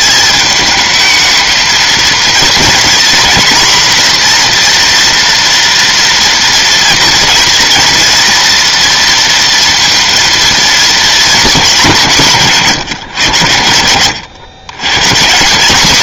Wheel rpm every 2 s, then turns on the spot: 210, 230, 240, 230, 230, 220, 150, 120.
none